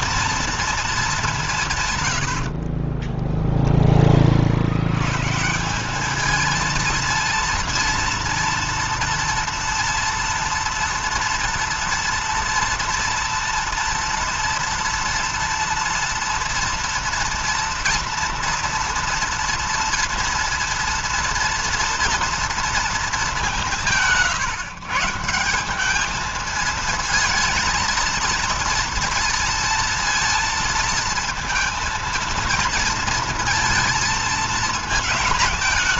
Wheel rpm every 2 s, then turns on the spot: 230, 50, 50, 220, 230, 230, 230, 240, 230, 230, 230, 230, 150, 220, 230, 230, 230, 220.
2-4